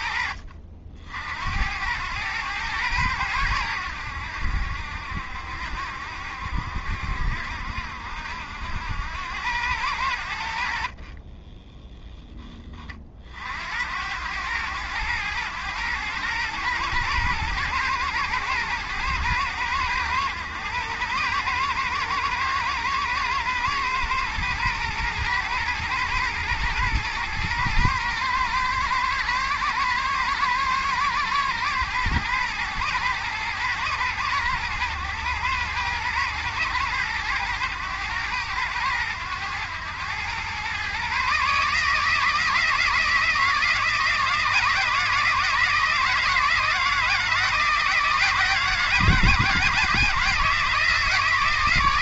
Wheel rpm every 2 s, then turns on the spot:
60, 100, 70, 70, 80, 40, 30, 100, 110, 120, 110, 110, 110, 110, 110, 110, 120, 110, 110, 100, 120, 160, 160, 160, 170, 160.
none